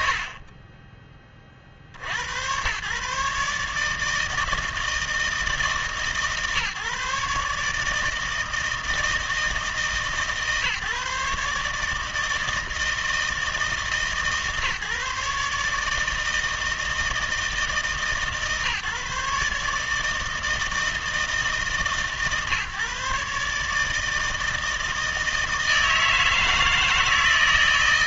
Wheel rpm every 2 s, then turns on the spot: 40, 110, 160, 140, 160, 150, 160, 150, 160, 150, 160, 140, 160, 160.
none